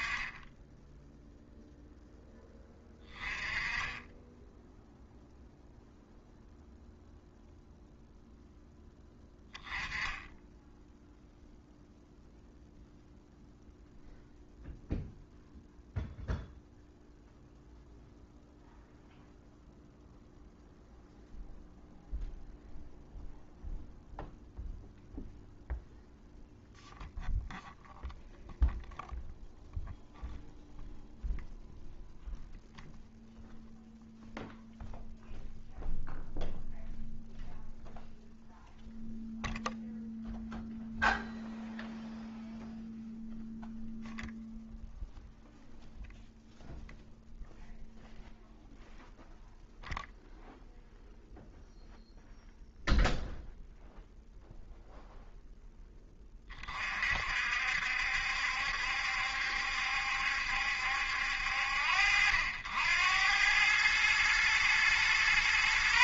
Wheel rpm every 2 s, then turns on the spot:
10, 10, 0, 0, 10, 0, 0, 0, 0, 0, 0, 0, 0, 0, 0, 0, 0, 0, 0, 0, 0, 0, 0, 0, 0, 0, 0, 0, 40, 70, 70, 80, 120.
none